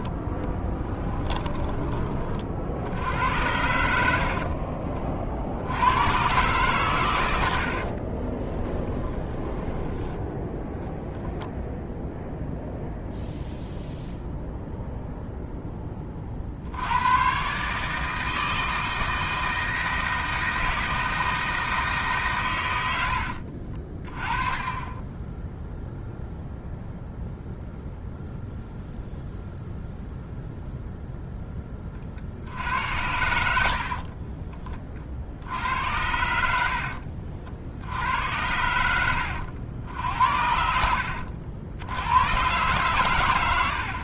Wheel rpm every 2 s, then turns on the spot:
10, 60, 50, 120, 20, 10, 0, 0, 70, 160, 160, 100, 30, 0, 0, 0, 70, 30, 70, 90, 60, 120.
0-2 8-10